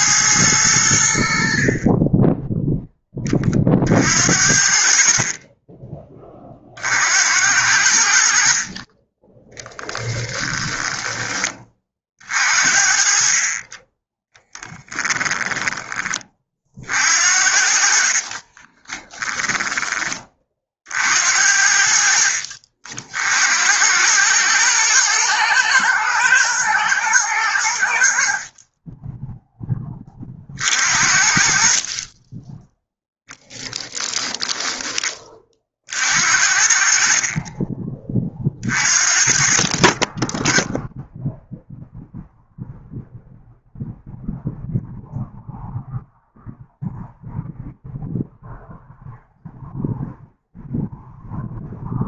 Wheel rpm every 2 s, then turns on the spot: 80, 10, 50, 60, 30, 10, 50, 10, 50, 20, 50, 60, 110, 110, 20, 50, 10, 20, 40, 40, 0, 0, 0, 0, 0, 0.
14-16 18-20 32-36